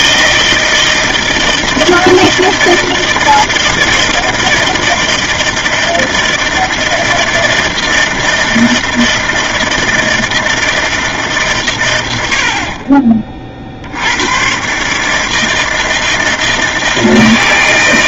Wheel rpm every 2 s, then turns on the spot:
160, 160, 160, 160, 160, 160, 40, 140, 160.
none